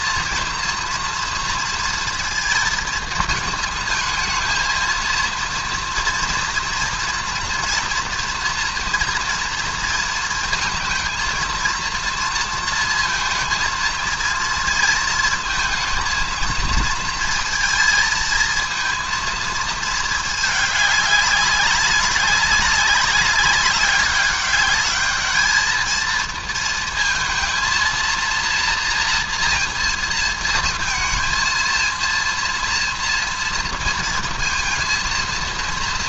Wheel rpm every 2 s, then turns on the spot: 230, 230, 220, 230, 230, 220, 230, 230, 230, 220, 220, 190, 200, 230, 230, 230, 230, 230.
none